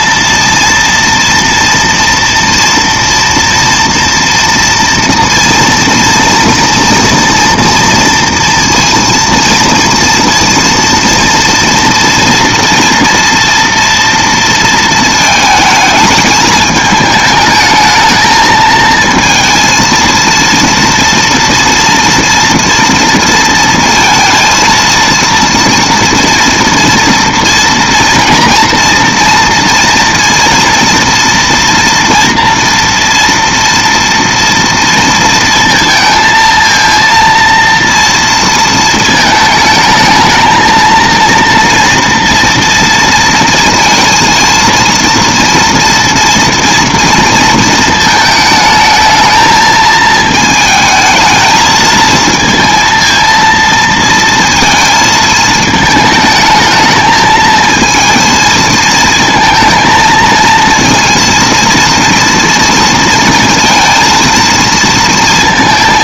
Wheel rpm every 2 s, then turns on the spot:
230, 230, 230, 230, 230, 230, 240, 230, 210, 220, 230, 230, 230, 230, 240, 230, 230, 230, 230, 230, 220, 230, 230, 230, 220, 220, 230, 230, 220, 220, 230, 230, 230.
none